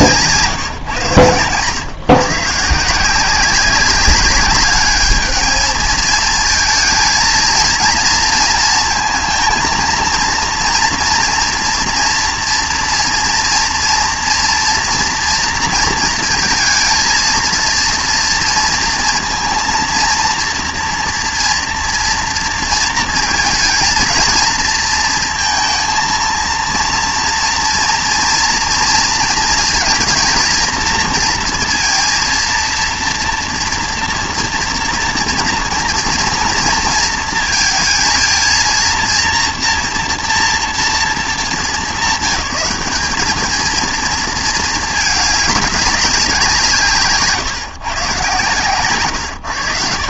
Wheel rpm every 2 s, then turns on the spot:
150, 160, 200, 220, 220, 230, 230, 230, 230, 230, 240, 230, 230, 230, 230, 230, 230, 240, 230, 230, 230, 200, 220, 170, 150.
none